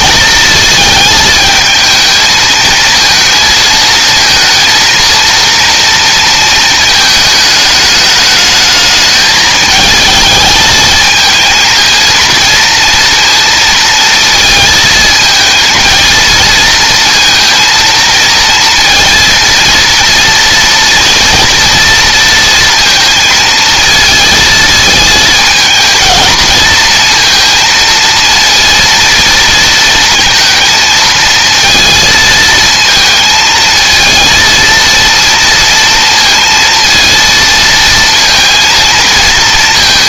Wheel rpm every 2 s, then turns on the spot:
220, 220, 230, 220, 220, 220, 230, 220, 230, 230, 230, 230, 230, 230, 230, 220, 220, 230, 230, 230.
none